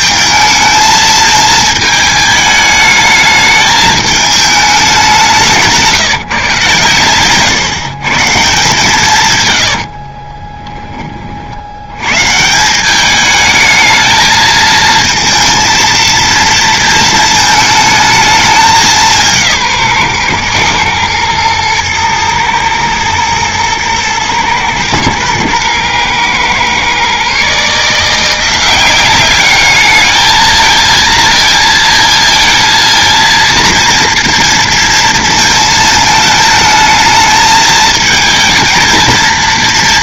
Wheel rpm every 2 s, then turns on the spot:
220, 210, 210, 130, 150, 30, 160, 220, 230, 200, 120, 110, 110, 120, 180, 220, 230, 230, 220, 220.
10-12